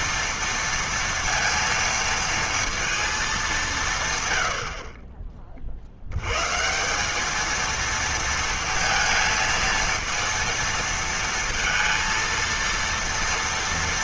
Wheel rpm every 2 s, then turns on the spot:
230, 230, 110, 120, 230, 230, 230.
none